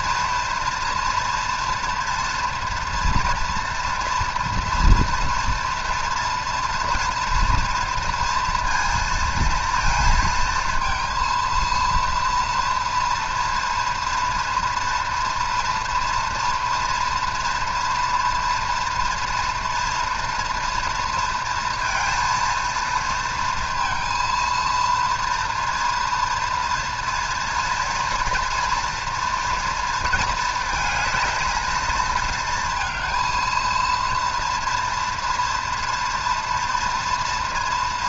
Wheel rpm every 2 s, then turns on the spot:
230, 230, 230, 230, 220, 230, 230, 230, 230, 240, 230, 230, 230, 230, 230, 220, 230, 230, 230.
none